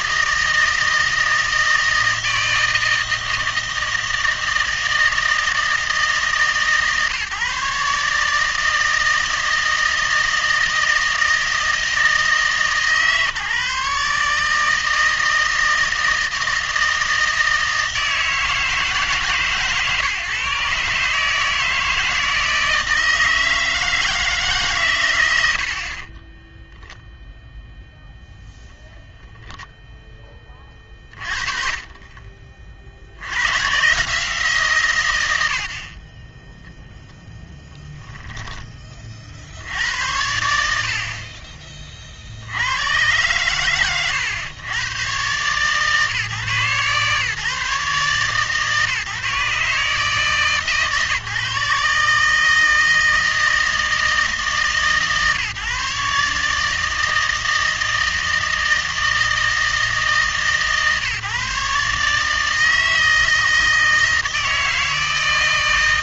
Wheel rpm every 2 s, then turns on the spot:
160, 160, 160, 150, 160, 160, 150, 160, 160, 150, 140, 160, 140, 0, 0, 20, 50, 140, 10, 30, 60, 100, 110, 140, 150, 150, 160, 140, 150, 160, 150, 160, 160.
none